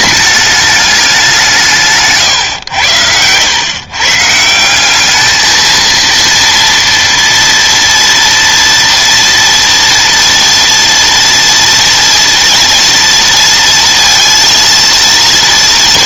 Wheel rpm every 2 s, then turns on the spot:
210, 100, 170, 240, 230, 230, 230, 230.
none